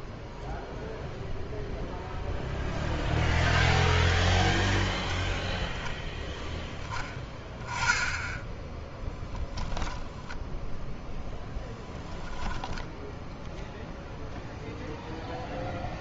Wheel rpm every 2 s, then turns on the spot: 0, 0, 0, 10, 10, 0, 10, 0.
12-14